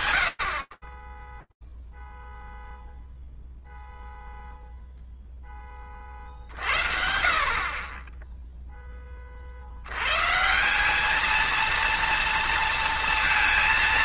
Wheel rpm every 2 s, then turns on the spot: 10, 0, 10, 40, 70, 220, 230.
none